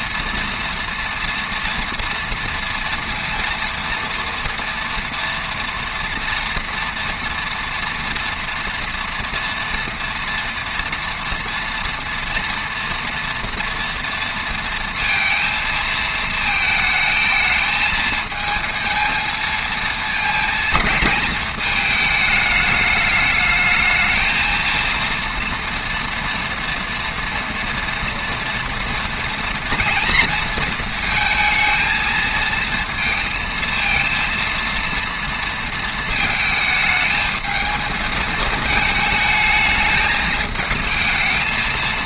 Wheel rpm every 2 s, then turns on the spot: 240, 240, 230, 230, 230, 230, 230, 230, 220, 220, 230, 210, 220, 230, 230, 230, 220, 230, 220, 220, 220.
none